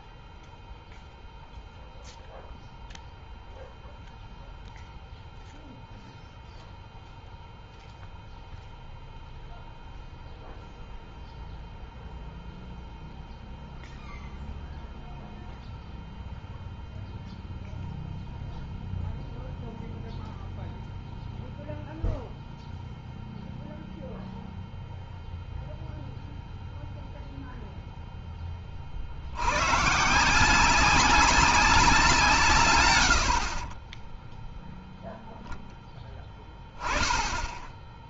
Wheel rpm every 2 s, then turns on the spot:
0, 0, 0, 0, 0, 0, 0, 0, 0, 0, 0, 0, 0, 0, 30, 180, 130, 0, 20.
none